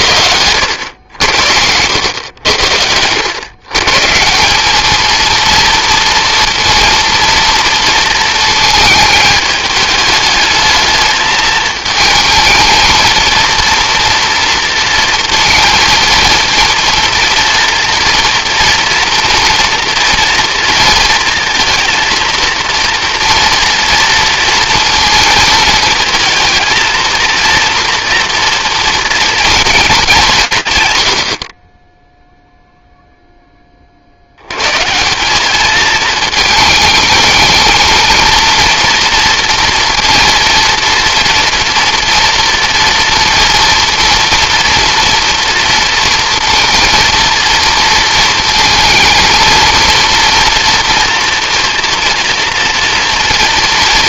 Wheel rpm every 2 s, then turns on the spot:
90, 90, 210, 230, 220, 220, 220, 230, 230, 230, 230, 230, 230, 230, 230, 120, 0, 130, 220, 230, 230, 230, 240, 230, 220, 230, 230.
none